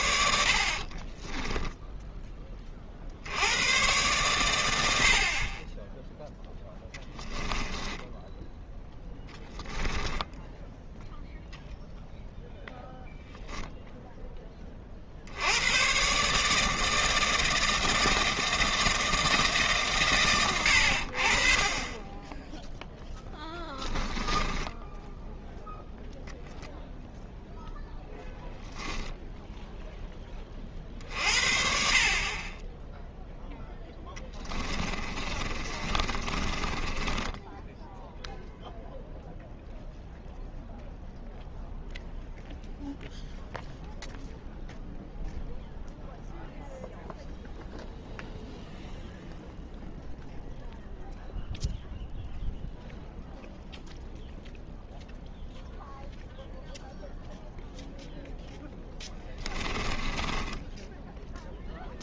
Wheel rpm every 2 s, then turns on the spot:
30, 50, 70, 10, 10, 0, 0, 50, 160, 160, 60, 0, 0, 0, 10, 50, 10, 30, 10, 0, 0, 0, 0, 0, 0, 0, 0, 0, 0, 10, 10.
0-2 6-8 34-38 58-62